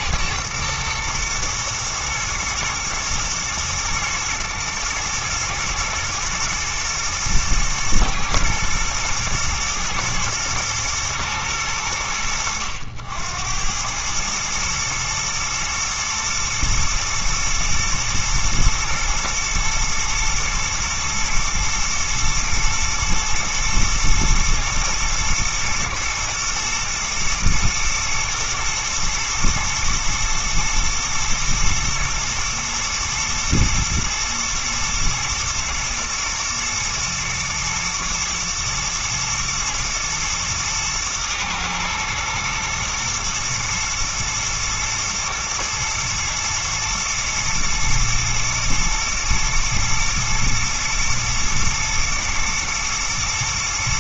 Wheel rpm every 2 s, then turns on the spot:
120, 110, 110, 110, 120, 120, 70, 110, 120, 110, 120, 120, 120, 120, 110, 110, 120, 110, 120, 110, 120, 110, 110, 120, 110, 120, 110.
none